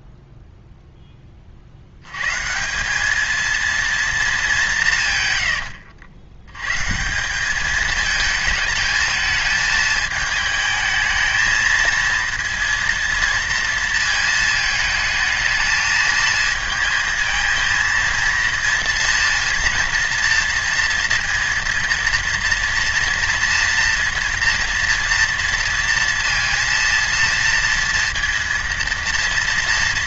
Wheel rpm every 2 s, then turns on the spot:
20, 200, 160, 150, 220, 220, 230, 220, 220, 230, 230, 240, 230, 230, 230.
none